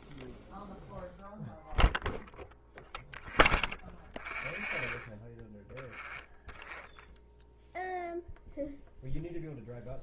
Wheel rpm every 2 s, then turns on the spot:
0, 0, 0, 0, 0.
none